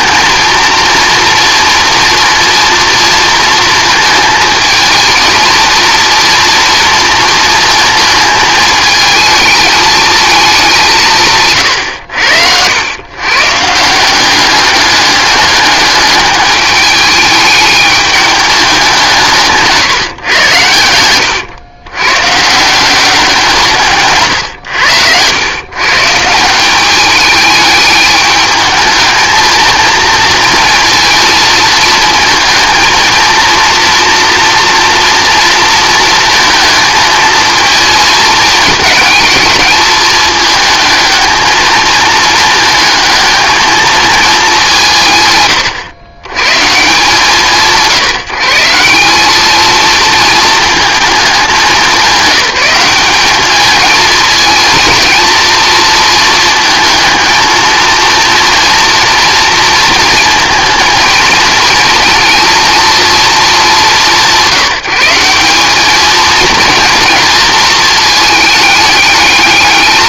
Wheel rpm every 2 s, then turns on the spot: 230, 230, 230, 230, 220, 210, 90, 200, 210, 200, 100, 160, 110, 180, 220, 220, 220, 230, 220, 220, 220, 220, 190, 140, 160, 220, 210, 230, 220, 230, 230, 230, 180, 230, 210.
24-26